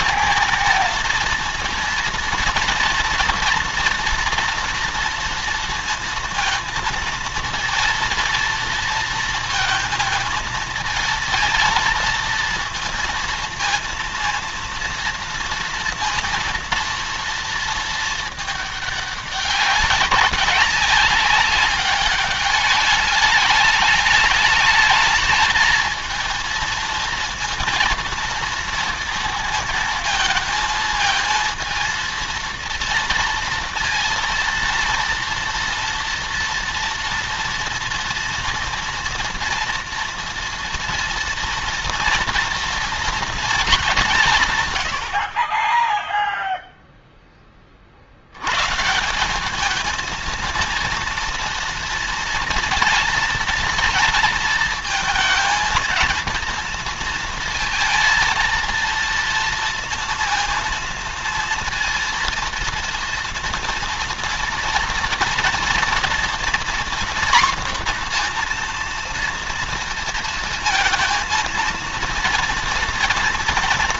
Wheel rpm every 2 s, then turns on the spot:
230, 230, 230, 230, 230, 220, 230, 230, 230, 210, 190, 200, 220, 230, 230, 220, 230, 230, 230, 240, 230, 230, 90, 0, 160, 230, 230, 230, 230, 230, 230, 230, 230, 240, 240, 230, 230.
none